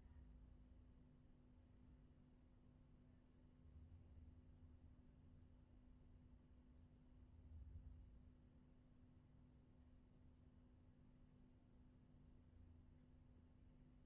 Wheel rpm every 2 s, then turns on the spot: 0, 0, 0, 0, 0, 0, 0.
none